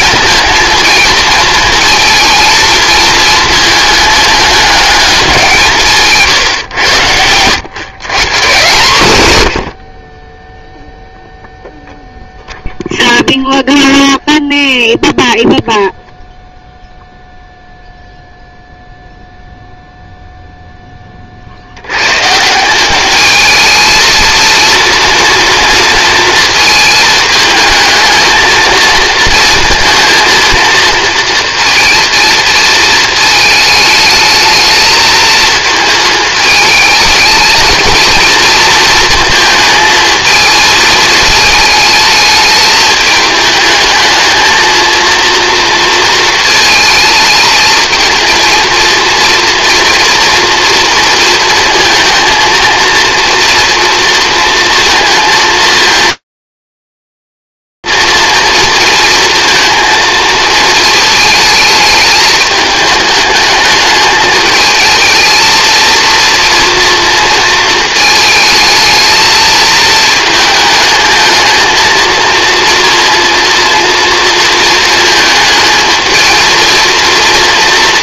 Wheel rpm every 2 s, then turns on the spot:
230, 230, 210, 140, 140, 10, 0, 0, 0, 0, 0, 150, 220, 220, 230, 230, 230, 220, 220, 230, 220, 210, 220, 220, 230, 230, 230, 230, 230, 230, 210, 210, 230, 220, 220, 230, 230, 220, 230.
none